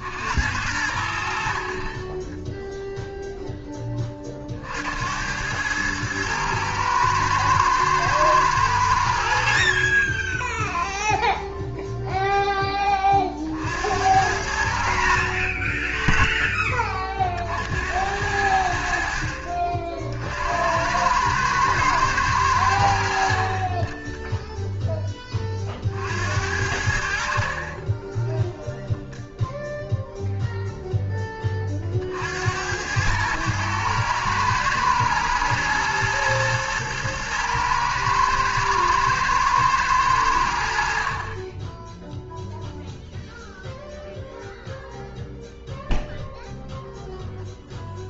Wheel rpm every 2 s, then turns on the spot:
80, 0, 60, 110, 100, 0, 10, 70, 20, 70, 80, 90, 0, 70, 10, 0, 90, 110, 110, 110, 60, 0, 0, 0.
none